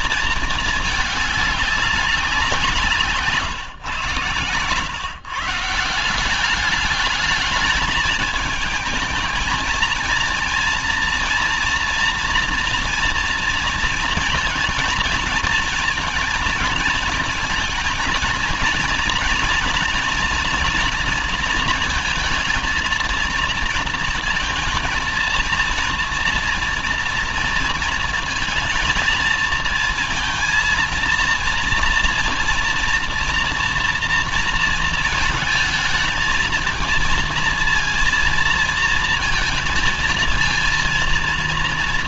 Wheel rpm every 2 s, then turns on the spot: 210, 150, 140, 210, 220, 230, 230, 230, 230, 240, 230, 230, 230, 230, 230, 230, 230, 230, 220, 230, 230.
none